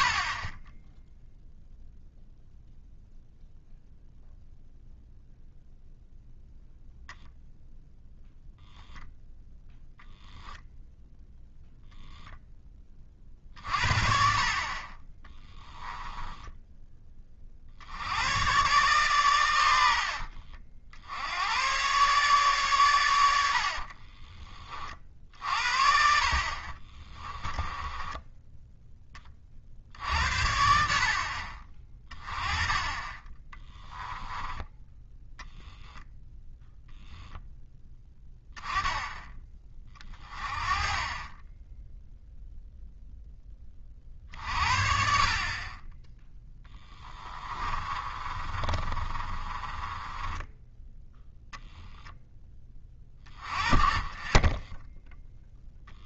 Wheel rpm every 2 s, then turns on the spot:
20, 0, 0, 0, 0, 0, 20, 40, 10, 120, 50, 110, 40, 40, 10, 70, 20, 10, 0, 10, 30, 0, 50, 10, 30, 10, 20, 10.
14-16 26-28 32-34 46-50